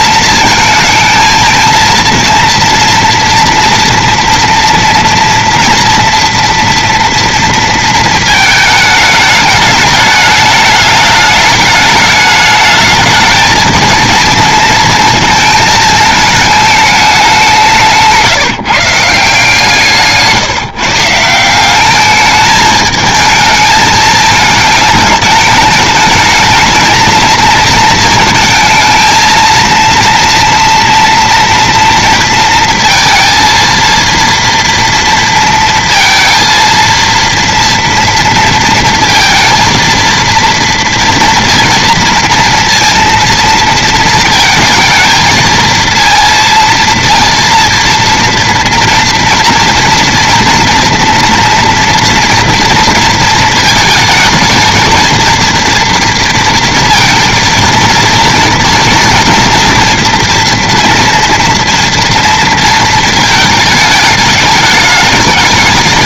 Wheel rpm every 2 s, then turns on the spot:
230, 230, 240, 230, 210, 210, 210, 230, 210, 160, 160, 210, 210, 220, 230, 230, 230, 230, 230, 230, 230, 230, 230, 230, 230, 230, 230, 230, 230, 230, 230, 230, 210.
none